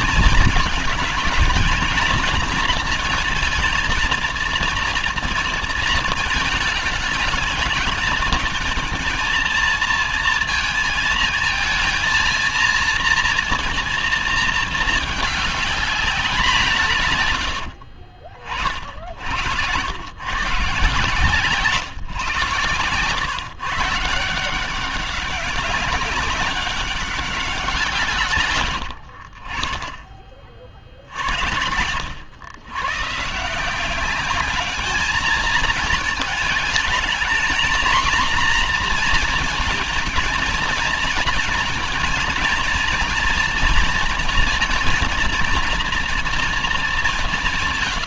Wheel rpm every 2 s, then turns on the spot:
220, 230, 230, 220, 220, 230, 230, 220, 180, 70, 150, 120, 190, 190, 80, 60, 120, 210, 220, 230, 230, 240, 230, 180.
none